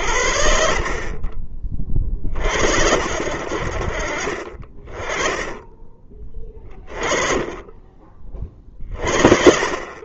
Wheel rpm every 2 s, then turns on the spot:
40, 60, 30, 20, 30.
none